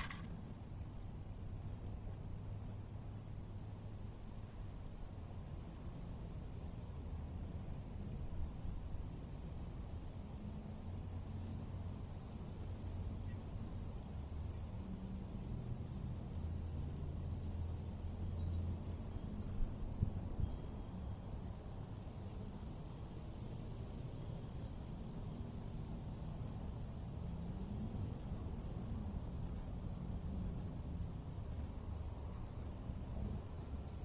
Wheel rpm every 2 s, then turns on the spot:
10, 0, 0, 0, 0, 0, 0, 0, 0, 0, 0, 0, 0, 0, 0, 0, 0.
none